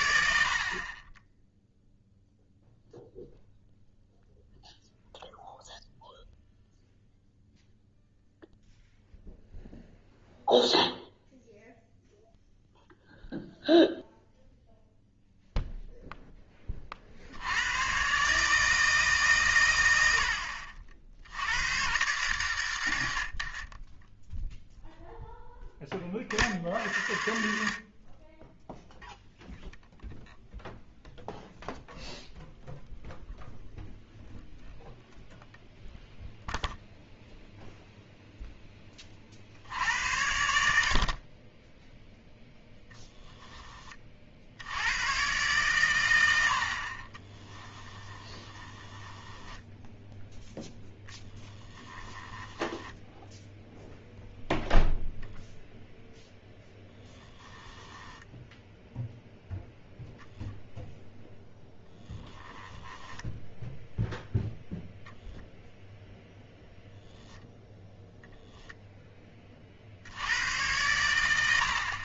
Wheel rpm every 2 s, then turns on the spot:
50, 0, 0, 0, 0, 0, 0, 0, 30, 160, 60, 100, 0, 60, 0, 0, 0, 0, 0, 20, 70, 0, 80, 50, 10, 0, 10, 0, 10, 0, 0, 20, 0, 0, 0, 110.
48-50 52-54 56-58 62-64